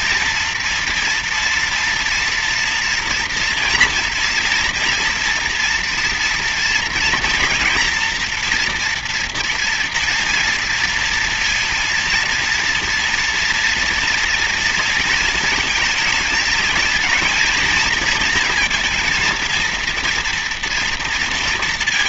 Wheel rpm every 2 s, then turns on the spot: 230, 240, 230, 230, 230, 230, 230, 230, 220, 230, 230.
none